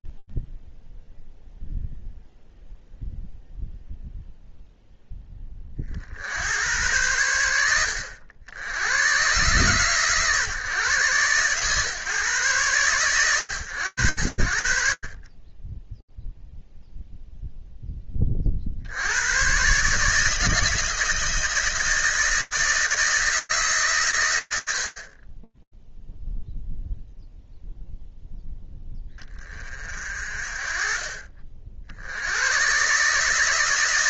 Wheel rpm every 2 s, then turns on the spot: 0, 0, 10, 100, 110, 130, 110, 40, 0, 110, 160, 160, 80, 0, 10, 40, 120.
none